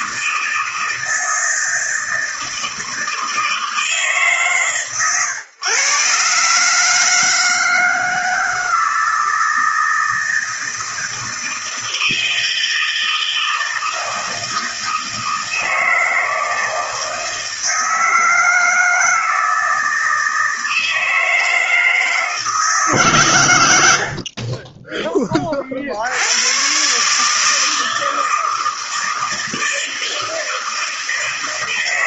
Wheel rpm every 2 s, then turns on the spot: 160, 160, 130, 160, 160, 160, 160, 160, 160, 160, 160, 130, 20, 140, 160, 160.
none